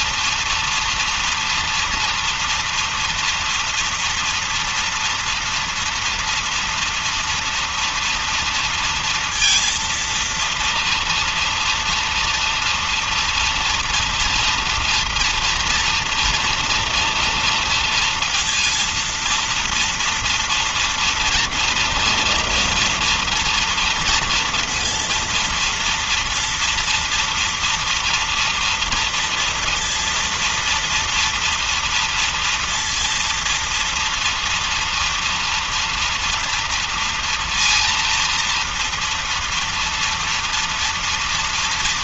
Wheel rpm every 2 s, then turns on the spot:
230, 230, 240, 230, 230, 230, 230, 230, 230, 230, 230, 240, 230, 230, 230, 230, 230, 230, 230, 230, 230.
none